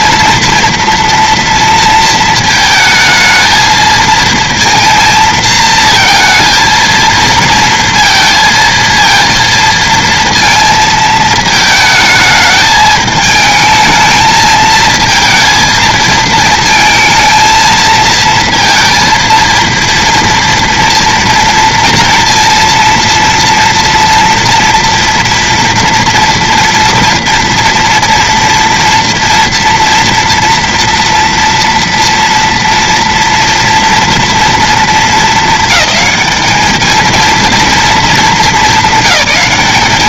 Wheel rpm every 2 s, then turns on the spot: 230, 220, 230, 220, 230, 230, 220, 220, 220, 230, 230, 230, 230, 230, 230, 230, 230, 230, 220, 220.
none